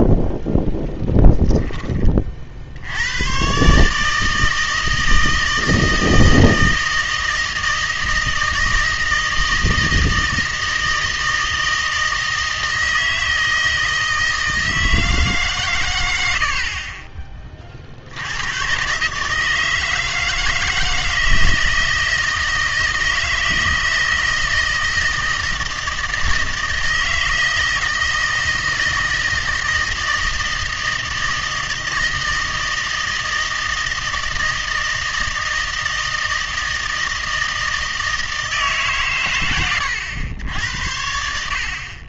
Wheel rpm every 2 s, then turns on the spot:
10, 60, 160, 160, 160, 160, 160, 160, 40, 120, 160, 160, 160, 160, 160, 160, 160, 160, 160, 150, 90.
none